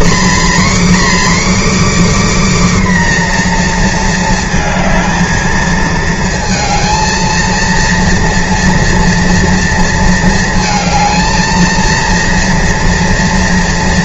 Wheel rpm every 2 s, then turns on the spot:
280, 280, 220, 220, 230, 220, 230.
none